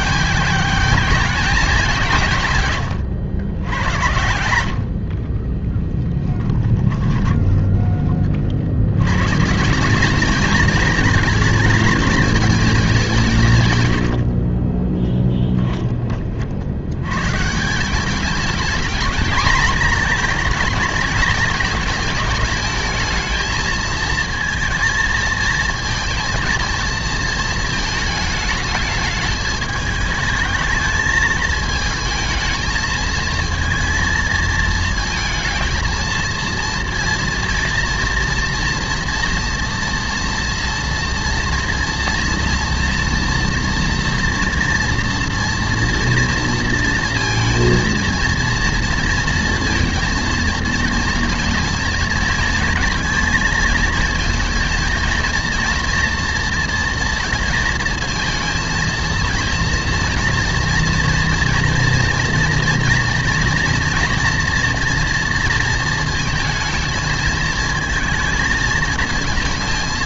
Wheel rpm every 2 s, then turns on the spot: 210, 130, 80, 10, 50, 220, 210, 30, 70, 210, 220, 220, 220, 230, 220, 220, 220, 220, 230, 230, 230, 230, 230, 230, 230, 230, 230, 230, 230, 230, 230, 230, 230, 230, 220.
4-8 14-16